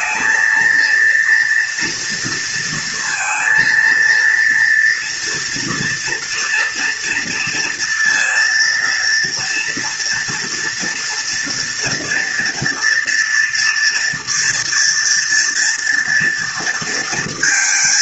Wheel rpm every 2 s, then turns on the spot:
230, 230, 230, 230, 230, 230, 240, 240, 230.
none